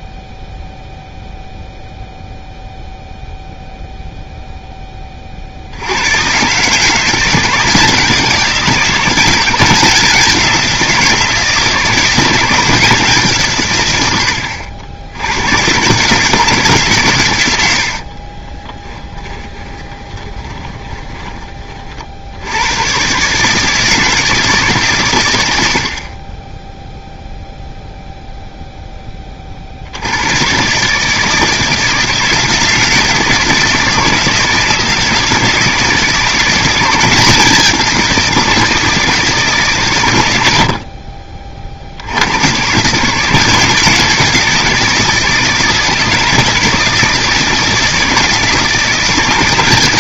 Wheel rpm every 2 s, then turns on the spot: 0, 0, 10, 150, 180, 180, 170, 80, 150, 20, 20, 100, 140, 0, 0, 140, 160, 160, 180, 170, 60, 140, 170, 160, 160.
18-22